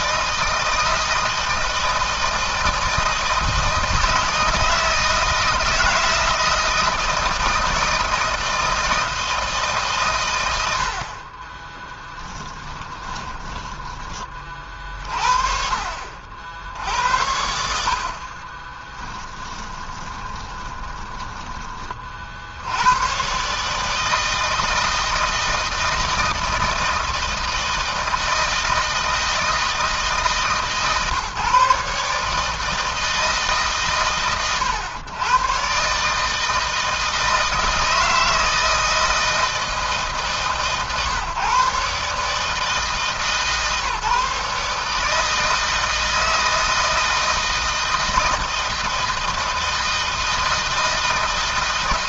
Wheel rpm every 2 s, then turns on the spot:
160, 160, 160, 160, 160, 70, 30, 40, 80, 20, 20, 110, 160, 160, 160, 150, 160, 110, 160, 160, 140, 150, 150, 160, 160, 160.
12-14 18-22